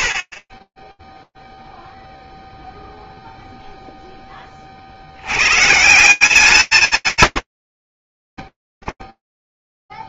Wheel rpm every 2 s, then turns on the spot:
60, 0, 70, 190, 10.
none